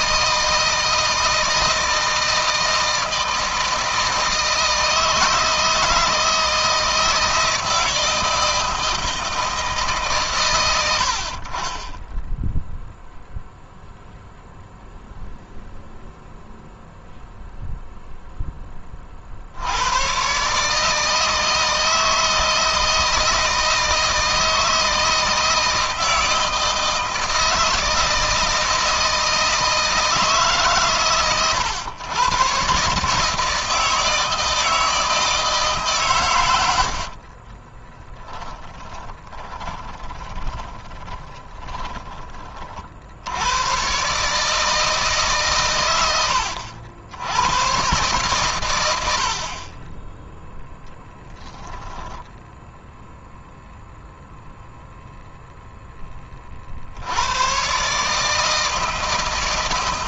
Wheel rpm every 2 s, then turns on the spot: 160, 160, 160, 160, 160, 80, 0, 0, 0, 30, 150, 160, 160, 160, 160, 130, 140, 160, 70, 10, 10, 60, 150, 80, 80, 0, 0, 0, 70, 160.
36-42